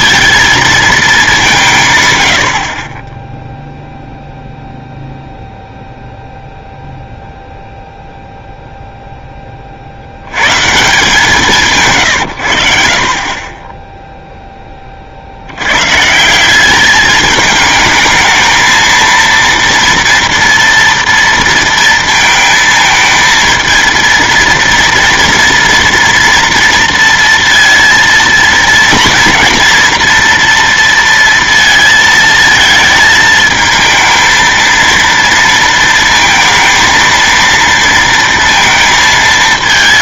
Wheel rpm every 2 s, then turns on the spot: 220, 40, 0, 0, 0, 140, 70, 20, 200, 220, 230, 220, 230, 230, 230, 230, 220, 230, 230, 230.
none